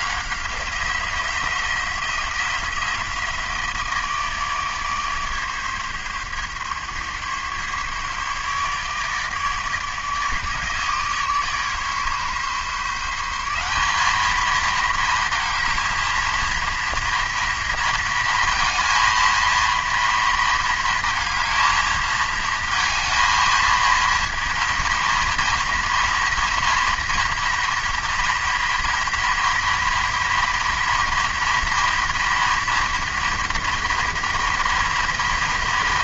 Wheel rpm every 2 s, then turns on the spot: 160, 170, 150, 140, 150, 150, 150, 220, 230, 230, 230, 220, 230, 230, 230, 230, 240, 230.
none